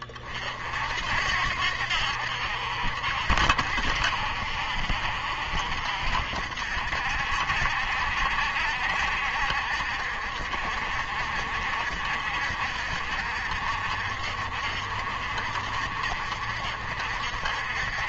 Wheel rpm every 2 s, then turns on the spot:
60, 60, 60, 60, 60, 60, 60, 60, 60.
none